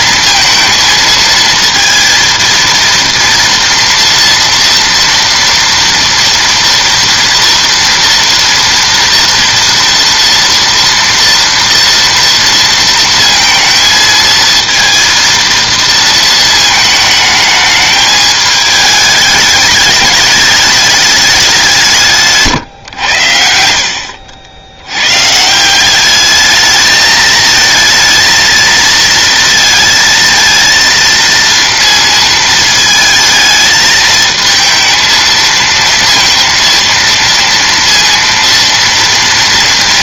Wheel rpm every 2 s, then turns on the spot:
220, 230, 230, 230, 230, 230, 230, 230, 220, 210, 210, 130, 90, 210, 230, 230, 230, 220, 230, 230.
none